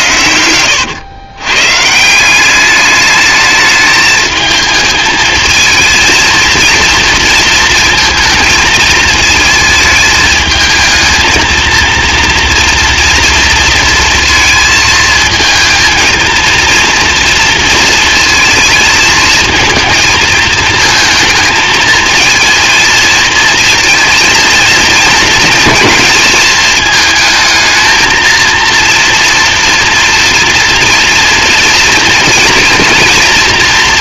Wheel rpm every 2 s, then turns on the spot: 100, 200, 220, 230, 220, 220, 230, 230, 230, 230, 220, 230, 230, 220, 230, 230, 230.
0-2